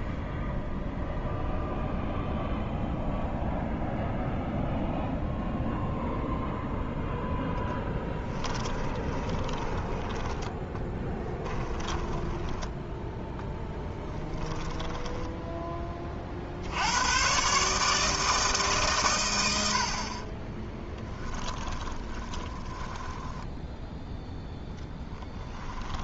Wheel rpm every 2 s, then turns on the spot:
0, 0, 0, 0, 20, 10, 0, 10, 70, 150, 20, 20, 0.
8-12 14-16 20-24